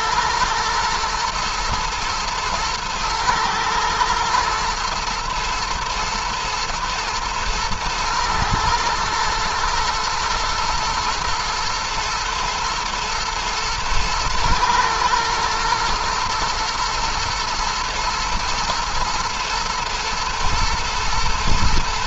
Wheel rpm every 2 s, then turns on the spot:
110, 110, 120, 120, 110, 120, 110, 110, 120, 110, 110.
none